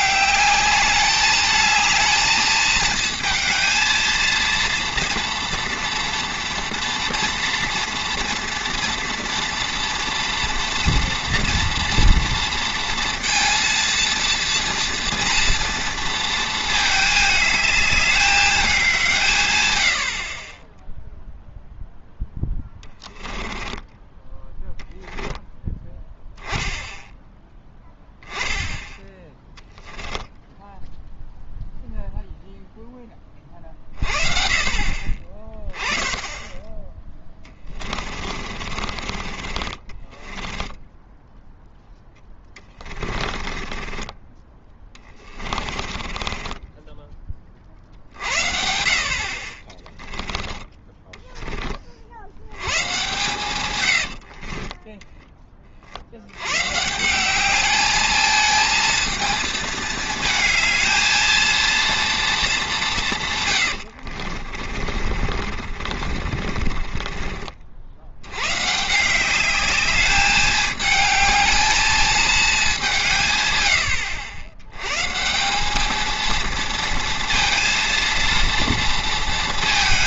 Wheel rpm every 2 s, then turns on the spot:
200, 220, 230, 230, 230, 240, 230, 230, 220, 200, 10, 10, 10, 10, 10, 0, 0, 40, 20, 30, 10, 20, 20, 10, 50, 10, 110, 30, 130, 220, 220, 190, 40, 40, 140, 210, 200, 110, 230, 230.
22-24 38-48 54-56 64-68